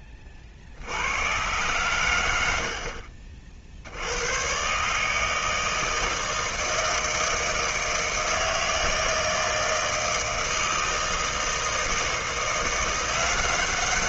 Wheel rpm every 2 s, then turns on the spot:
70, 60, 140, 160, 160, 160, 170.
none